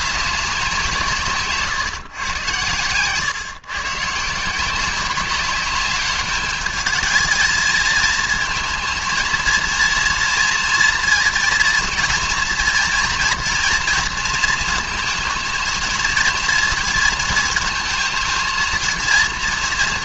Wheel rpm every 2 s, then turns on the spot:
190, 120, 160, 210, 230, 230, 230, 230, 230, 220.
none